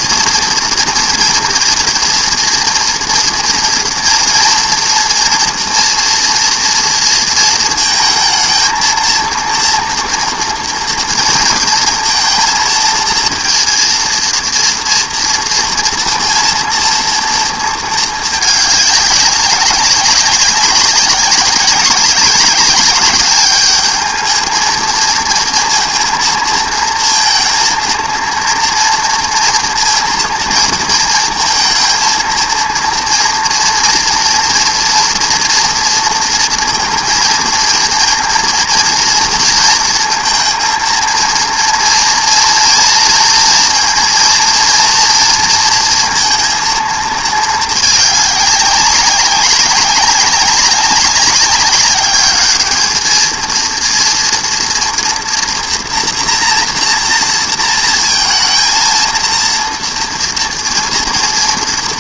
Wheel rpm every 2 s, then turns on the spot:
240, 240, 230, 240, 220, 230, 230, 230, 230, 220, 200, 200, 220, 230, 230, 230, 230, 240, 230, 230, 230, 230, 230, 230, 210, 190, 200, 240, 230, 220, 230.
none